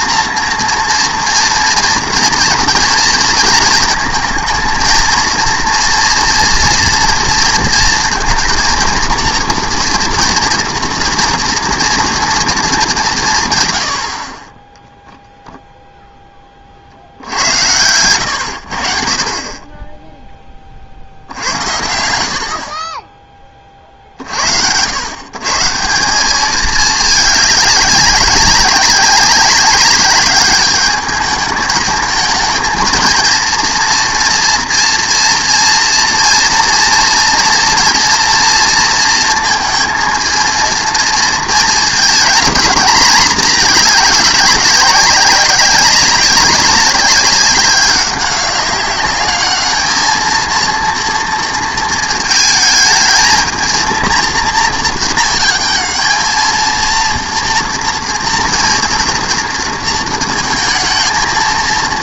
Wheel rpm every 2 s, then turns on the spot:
230, 230, 230, 230, 230, 230, 220, 20, 40, 70, 30, 50, 80, 210, 200, 210, 220, 230, 230, 230, 230, 220, 200, 190, 200, 230, 220, 230, 230, 230, 220.
none